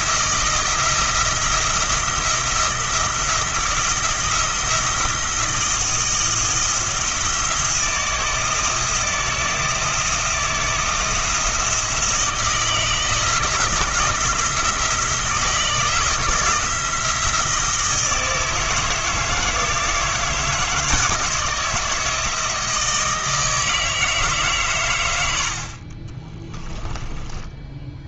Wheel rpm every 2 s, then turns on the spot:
170, 170, 170, 170, 160, 170, 170, 170, 170, 160, 160, 160, 130, 10.
26-28